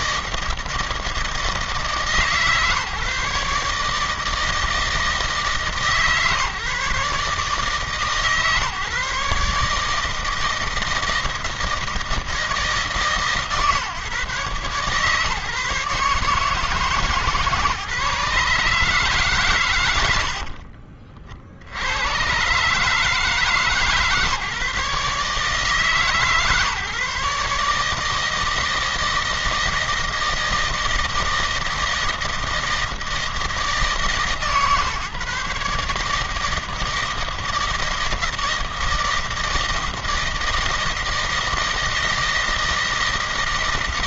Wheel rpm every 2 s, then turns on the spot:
160, 150, 160, 150, 150, 160, 150, 140, 150, 150, 60, 140, 150, 150, 160, 160, 160, 140, 160, 160, 160, 160.
20-22